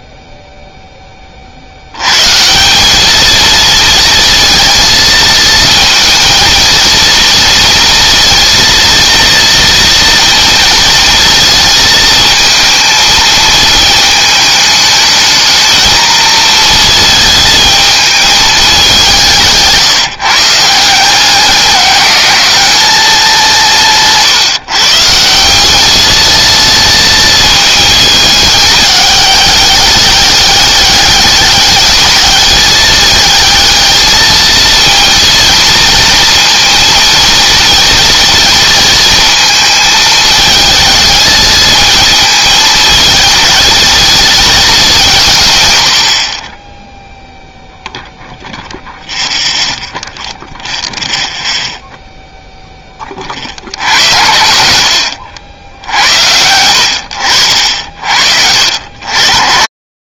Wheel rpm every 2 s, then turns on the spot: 30, 220, 230, 230, 230, 230, 220, 210, 220, 180, 180, 190, 150, 220, 200, 200, 220, 230, 230, 230, 220, 220, 170, 0, 0, 0, 10, 70, 80, 70.
none